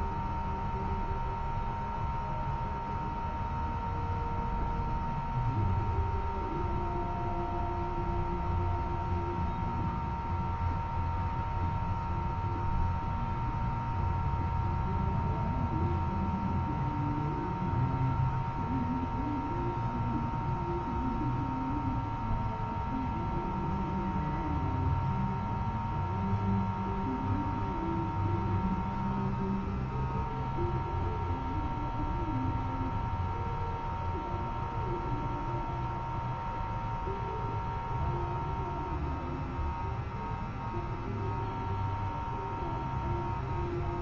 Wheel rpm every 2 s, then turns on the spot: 0, 0, 0, 0, 0, 0, 0, 0, 0, 0, 0, 0, 0, 0, 0, 0, 0, 0, 0, 0, 0, 0.
none